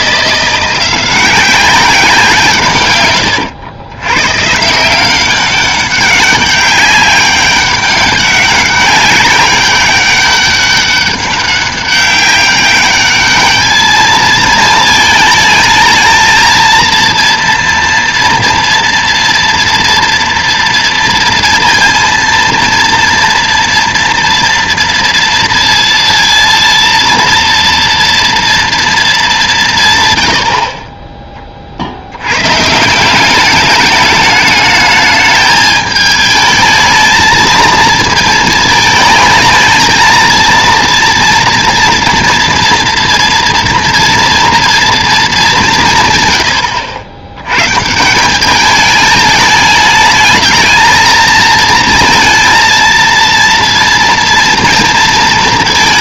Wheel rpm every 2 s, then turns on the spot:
180, 140, 150, 200, 190, 200, 200, 220, 230, 230, 230, 230, 230, 230, 230, 40, 150, 210, 220, 220, 230, 230, 230, 90, 210, 220, 230, 230.
none